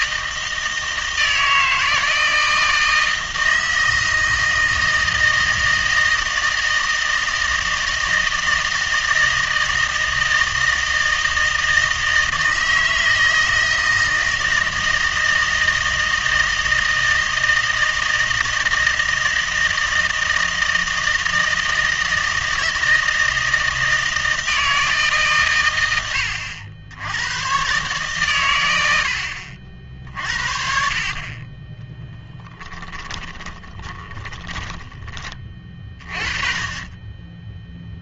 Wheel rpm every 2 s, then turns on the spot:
160, 160, 160, 160, 160, 160, 160, 160, 160, 160, 160, 160, 160, 90, 100, 50, 10, 20, 30.
32-36